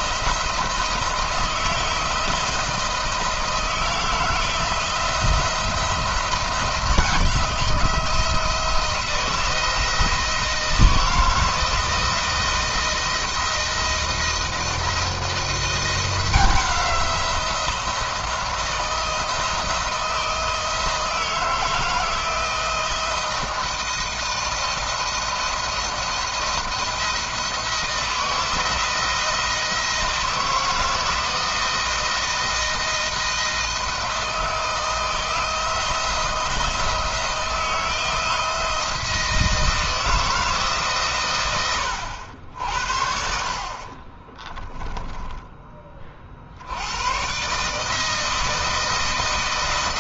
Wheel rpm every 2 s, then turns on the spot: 160, 160, 160, 170, 170, 160, 170, 160, 180, 170, 160, 160, 170, 170, 160, 160, 160, 160, 160, 170, 160, 80, 30, 60, 160.
44-46